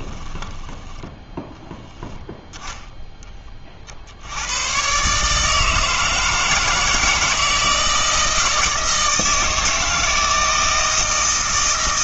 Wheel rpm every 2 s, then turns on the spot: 10, 0, 120, 160, 160, 160.
0-2